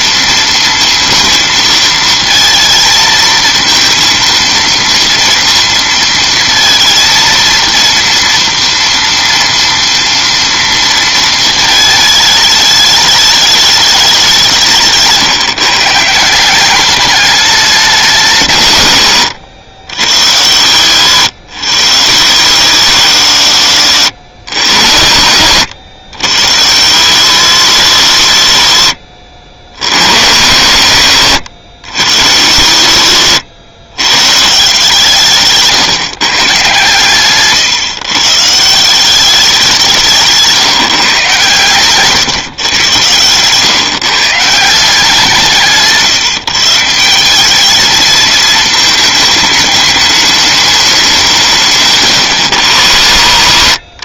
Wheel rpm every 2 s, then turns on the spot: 230, 220, 230, 230, 230, 230, 210, 180, 190, 150, 80, 100, 100, 90, 70, 110, 70, 150, 150, 160, 160, 120, 170, 170, 220, 210, 90.
none